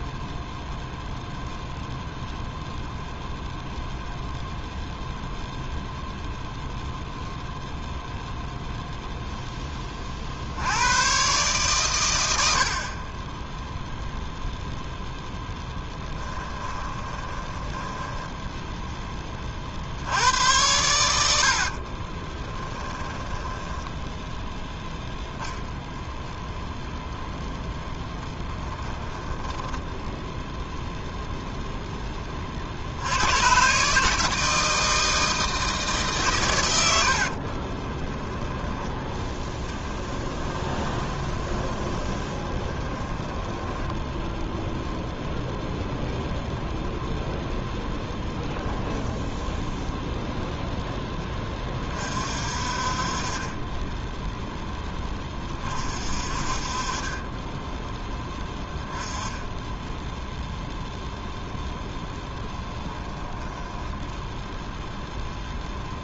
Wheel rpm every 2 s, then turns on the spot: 0, 0, 0, 0, 0, 90, 50, 0, 20, 10, 90, 20, 0, 0, 10, 0, 60, 160, 110, 10, 20, 20, 0, 0, 10, 0, 50, 10, 40, 10, 0, 10, 0.
16-18 20-24 28-30 38-44 48-50